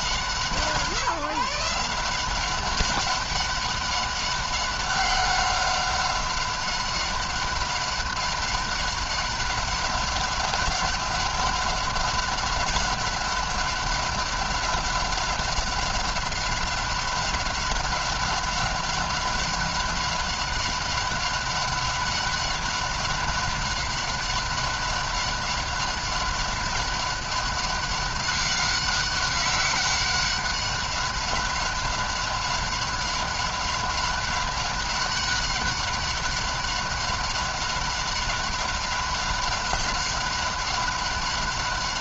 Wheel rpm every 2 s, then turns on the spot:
170, 180, 190, 190, 190, 190, 190, 190, 190, 190, 190, 190, 190, 200, 190, 190, 190, 190, 190, 190, 190.
none